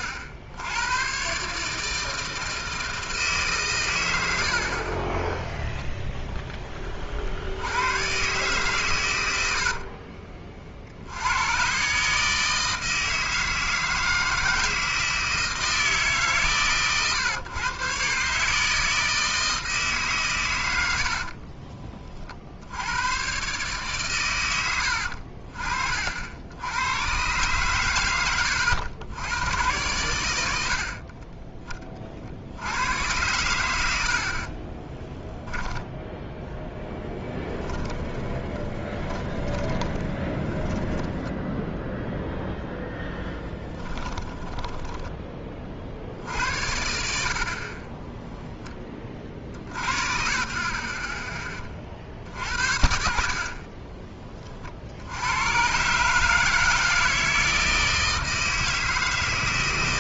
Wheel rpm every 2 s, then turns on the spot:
100, 160, 70, 10, 130, 40, 160, 160, 130, 150, 120, 60, 100, 80, 90, 80, 70, 40, 10, 20, 20, 0, 10, 70, 10, 50, 60, 30, 160, 160.
34-36 38-42 44-48 50-52